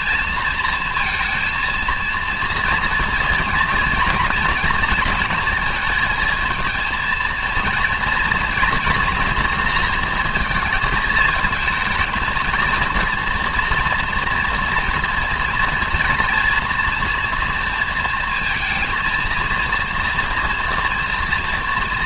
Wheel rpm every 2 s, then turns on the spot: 230, 230, 230, 230, 240, 220, 230, 240, 230, 230, 230.
none